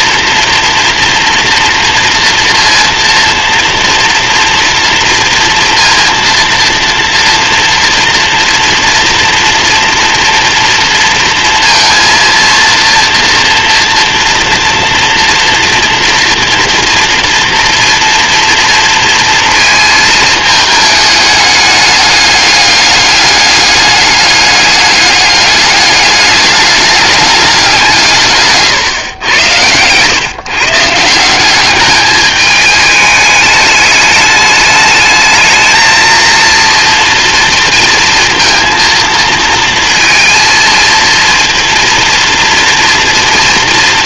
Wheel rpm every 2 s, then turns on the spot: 230, 230, 230, 230, 230, 230, 230, 230, 230, 230, 220, 210, 200, 210, 130, 160, 210, 210, 230, 230, 230, 230.
none